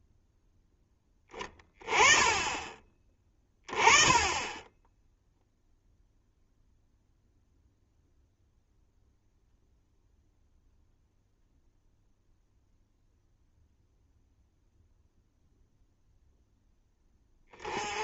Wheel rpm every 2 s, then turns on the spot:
10, 20, 10, 0, 0, 0, 0, 0, 10.
none